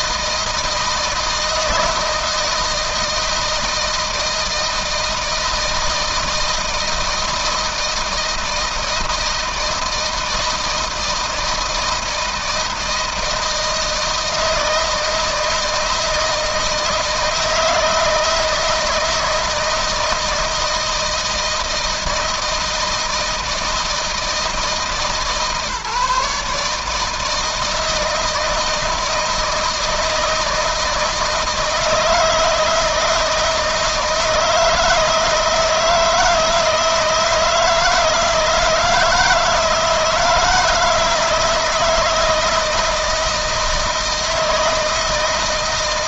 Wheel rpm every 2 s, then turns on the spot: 160, 160, 160, 160, 160, 160, 170, 170, 160, 160, 160, 160, 160, 150, 160, 160, 160, 160, 160, 160, 170, 160, 160.
none